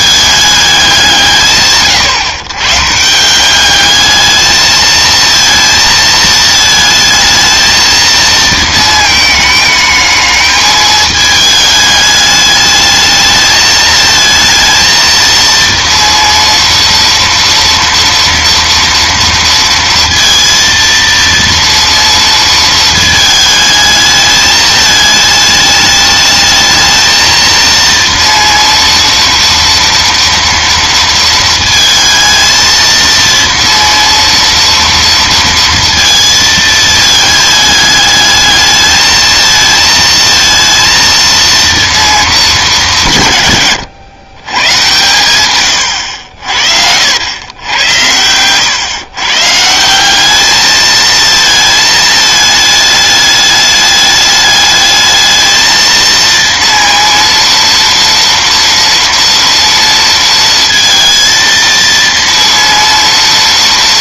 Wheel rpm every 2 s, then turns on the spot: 200, 140, 220, 220, 220, 210, 210, 230, 230, 240, 230, 230, 210, 220, 230, 230, 230, 230, 220, 210, 230, 200, 120, 70, 110, 210, 210, 210, 230, 230, 230, 230.
none